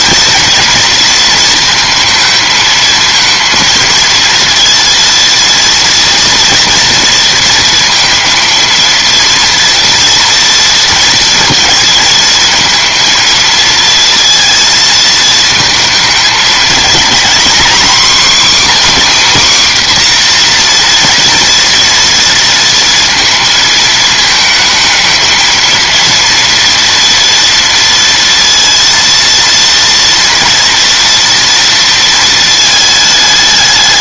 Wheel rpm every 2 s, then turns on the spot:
230, 220, 230, 230, 230, 230, 220, 230, 220, 230, 240, 230, 220, 230, 230, 230, 220.
none